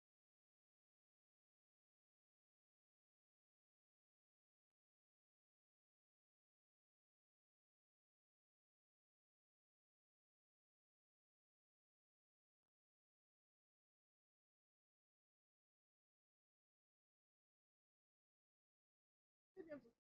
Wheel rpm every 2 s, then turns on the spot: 0, 0, 0, 0, 0, 0, 0, 0, 0, 0.
none